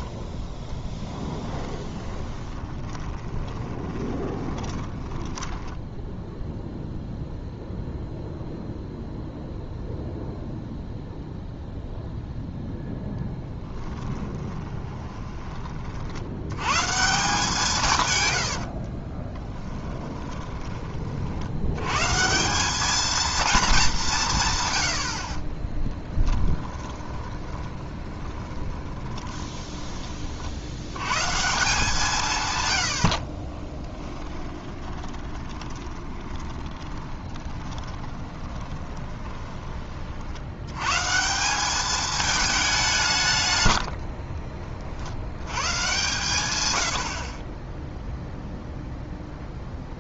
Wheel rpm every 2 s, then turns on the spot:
10, 30, 20, 0, 0, 0, 0, 20, 130, 60, 20, 200, 90, 20, 20, 70, 100, 20, 20, 20, 100, 180, 50, 90, 0.
0-6 14-16 18-20 26-30 34-40